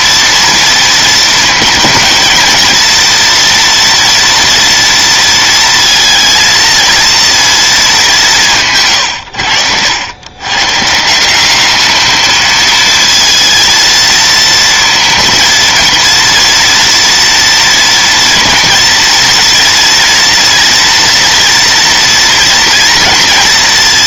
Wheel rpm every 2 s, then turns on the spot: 230, 230, 230, 230, 90, 150, 220, 230, 240, 230, 230, 230.
none